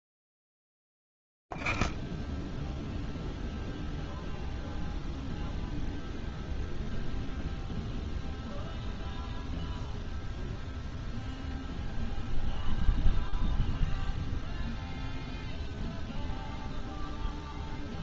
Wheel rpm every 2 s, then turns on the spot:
10, 20, 0, 0, 0, 0, 0, 0, 0.
0-4